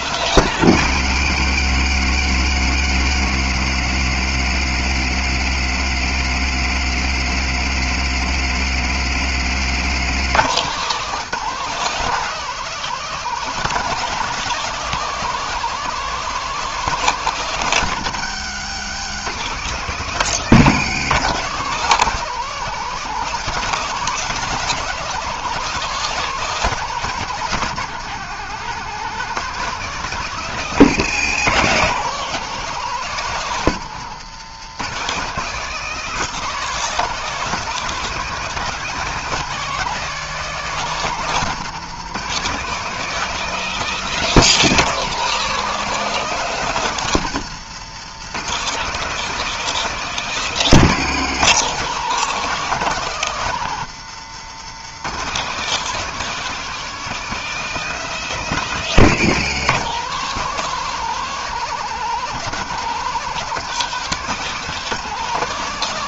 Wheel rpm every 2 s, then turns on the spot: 120, 100, 90, 90, 100, 180, 190, 190, 180, 160, 170, 200, 200, 190, 190, 160, 170, 180, 190, 200, 180, 200, 190, 160, 200, 180, 170, 170, 200, 170, 190, 180, 190.
none